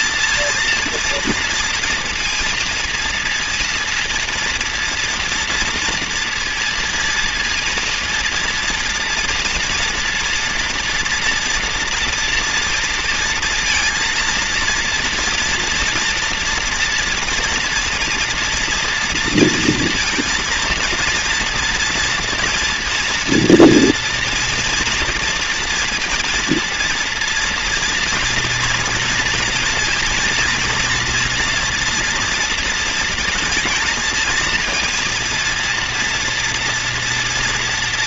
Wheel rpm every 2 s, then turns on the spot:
230, 230, 230, 230, 230, 230, 230, 230, 230, 230, 230, 230, 230, 230, 230, 230, 230, 230, 230.
none